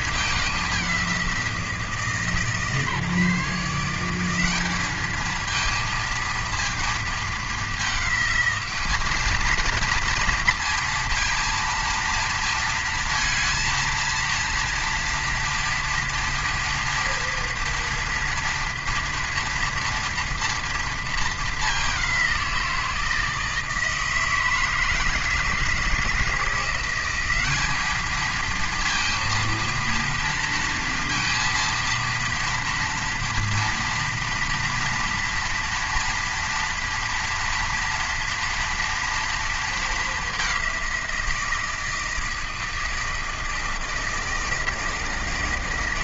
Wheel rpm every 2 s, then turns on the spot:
200, 150, 200, 230, 210, 230, 230, 230, 230, 230, 230, 170, 160, 170, 230, 230, 230, 240, 230, 230, 190, 160, 160.
none